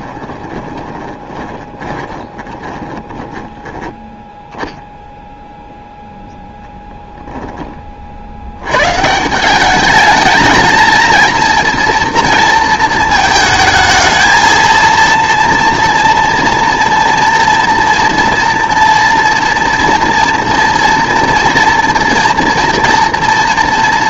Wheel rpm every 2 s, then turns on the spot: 20, 20, 0, 0, 100, 220, 230, 230, 230, 230, 240, 230.
0-4